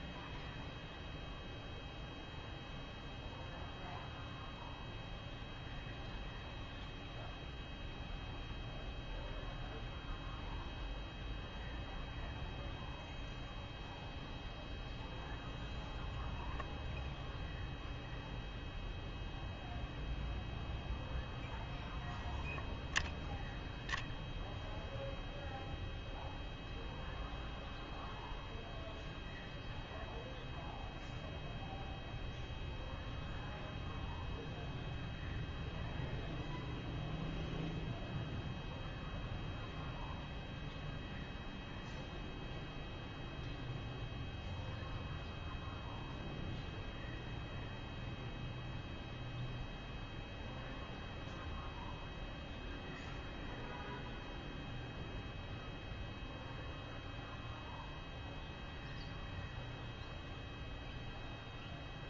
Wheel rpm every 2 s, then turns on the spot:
0, 0, 0, 0, 0, 0, 10, 10, 0, 0, 0, 10, 30, 0, 0, 0, 0, 0, 0, 0, 0, 0, 0, 0, 0, 0, 0, 0, 0, 0, 0.
none